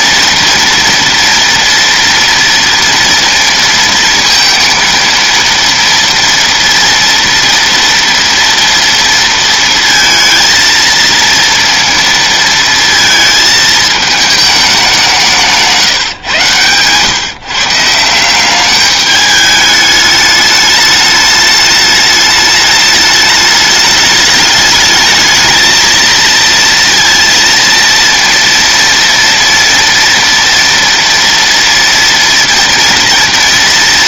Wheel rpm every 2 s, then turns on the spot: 230, 230, 230, 230, 230, 230, 230, 200, 130, 190, 210, 210, 210, 230, 230, 230, 230.
16-18